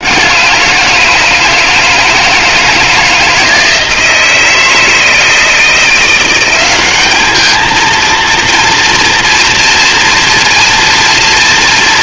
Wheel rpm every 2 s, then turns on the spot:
160, 160, 170, 210, 230, 230.
none